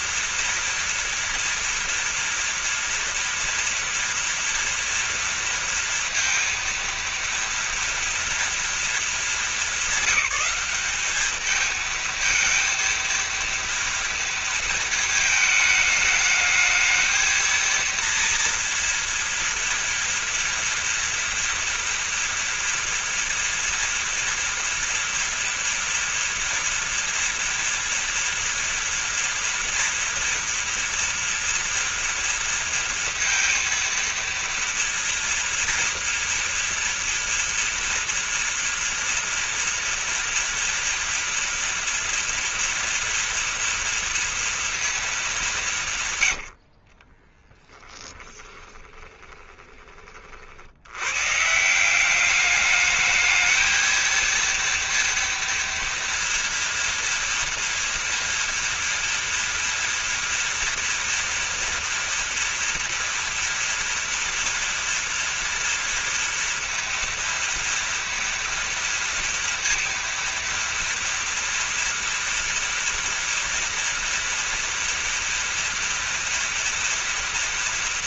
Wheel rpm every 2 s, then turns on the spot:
230, 230, 230, 230, 230, 190, 220, 230, 220, 230, 230, 230, 230, 230, 240, 240, 230, 230, 240, 230, 230, 230, 230, 80, 20, 80, 210, 230, 240, 240, 230, 230, 230, 230, 230, 230, 240, 240, 230.
46-50